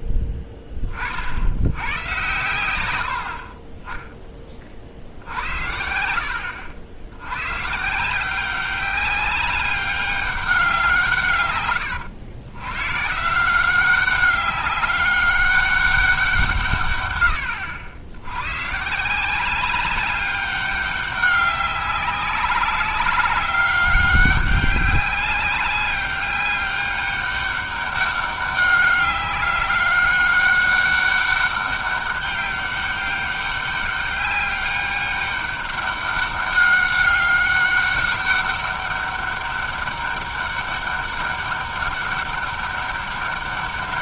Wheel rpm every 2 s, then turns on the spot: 40, 80, 60, 90, 190, 170, 130, 200, 140, 160, 190, 200, 200, 200, 200, 200, 200, 200, 200, 200, 200, 200.
none